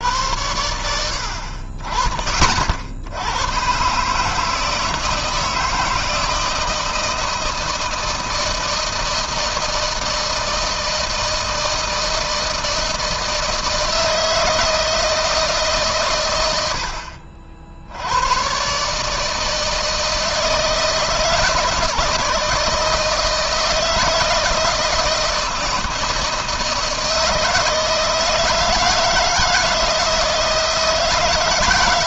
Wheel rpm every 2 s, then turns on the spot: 80, 80, 160, 170, 160, 160, 160, 160, 60, 140, 160, 160, 160, 160, 160, 160.
none